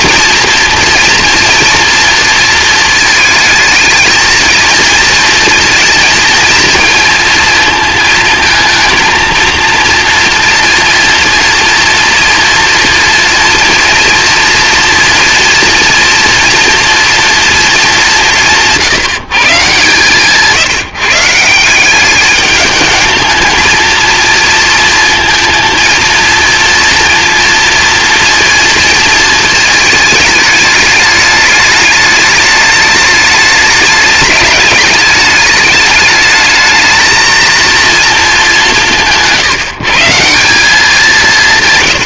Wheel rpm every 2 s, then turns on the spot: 230, 220, 230, 230, 230, 240, 230, 230, 240, 160, 160, 210, 230, 230, 230, 210, 220, 210, 230, 160, 170.
none